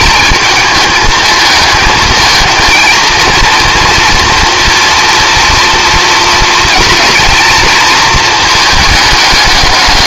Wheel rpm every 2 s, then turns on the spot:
220, 230, 230, 230, 210.
none